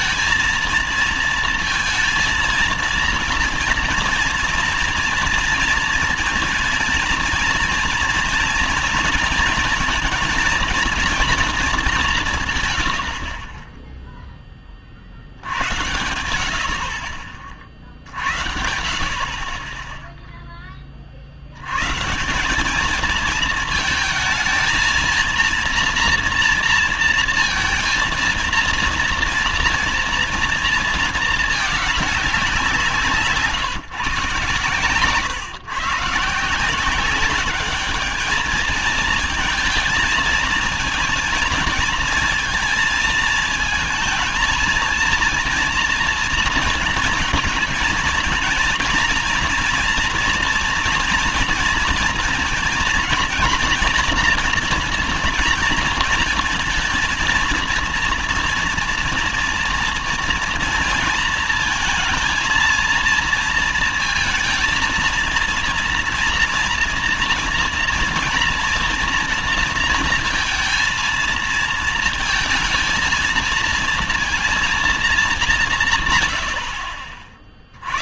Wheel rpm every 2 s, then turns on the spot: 230, 230, 230, 230, 240, 230, 120, 30, 60, 70, 10, 190, 220, 230, 230, 230, 180, 140, 170, 220, 230, 220, 230, 230, 230, 230, 230, 230, 230, 240, 230, 230, 230, 230, 230, 230, 220, 230, 90.
none